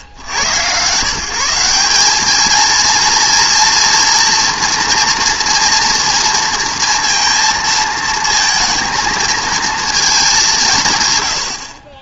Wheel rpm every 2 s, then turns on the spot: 140, 230, 230, 230, 230, 160.
none